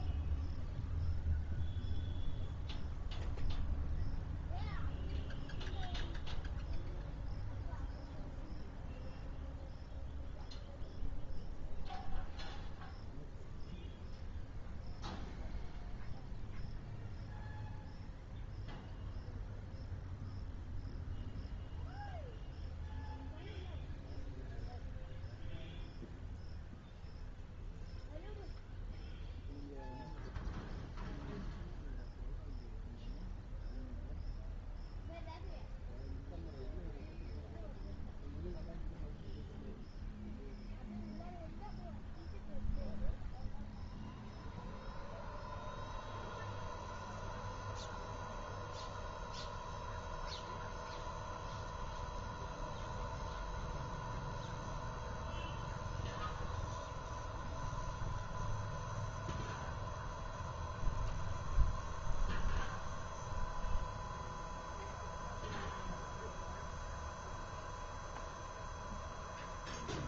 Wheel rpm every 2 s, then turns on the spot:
0, 0, 0, 0, 0, 0, 0, 0, 0, 0, 0, 0, 0, 0, 0, 0, 0, 0, 0, 0, 0, 0, 0, 0, 0, 0, 0, 0, 0, 0, 0, 0, 0, 0, 0.
none